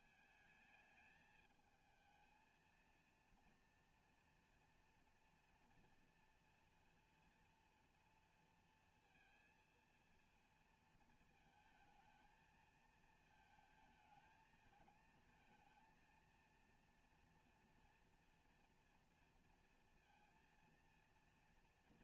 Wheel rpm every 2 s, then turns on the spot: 220, 220, 230, 230, 230, 230, 220, 220, 230, 230, 230.
none